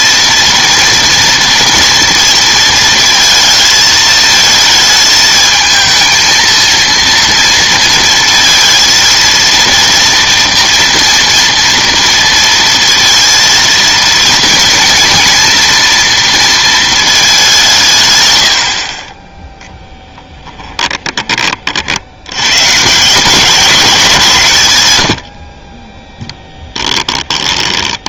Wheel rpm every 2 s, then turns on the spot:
230, 230, 220, 230, 220, 240, 230, 230, 230, 80, 20, 130, 130, 10.
20-22 26-28